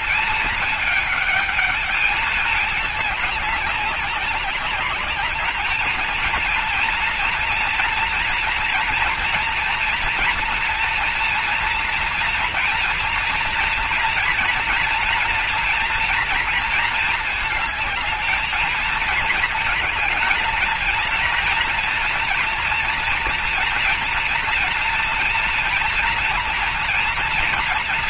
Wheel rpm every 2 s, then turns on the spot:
220, 210, 200, 230, 230, 230, 230, 230, 230, 220, 220, 230, 230, 230.
none